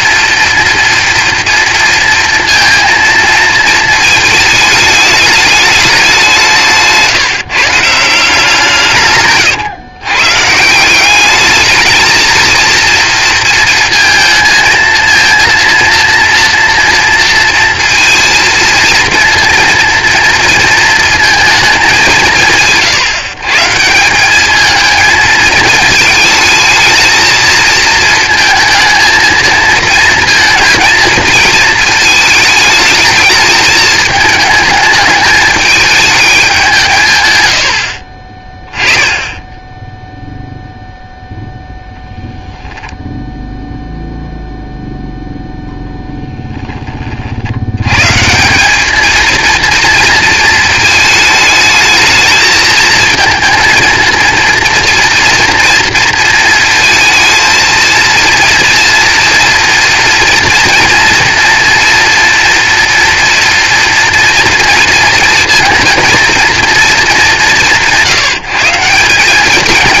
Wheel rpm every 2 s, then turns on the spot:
230, 230, 210, 150, 150, 170, 230, 230, 230, 230, 230, 160, 220, 220, 220, 230, 220, 220, 170, 20, 0, 0, 0, 10, 200, 220, 220, 230, 230, 230, 230, 230, 230, 230, 170.
none